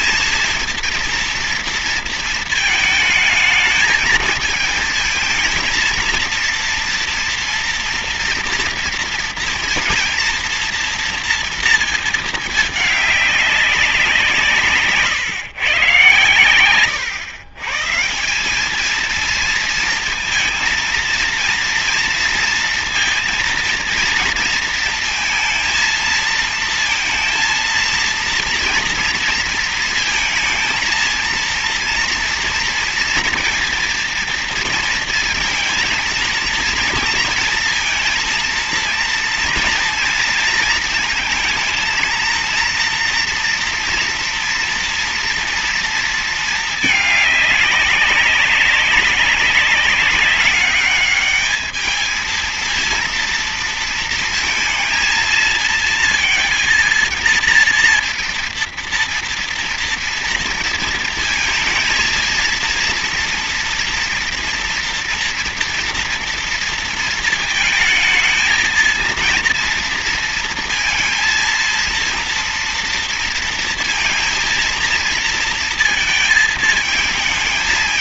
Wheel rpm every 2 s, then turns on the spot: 230, 220, 220, 230, 230, 230, 210, 160, 120, 200, 230, 230, 230, 230, 230, 220, 230, 230, 230, 230, 230, 230, 230, 220, 200, 200, 230, 230, 230, 230, 230, 230, 240, 230, 230, 230, 230, 230, 220.
none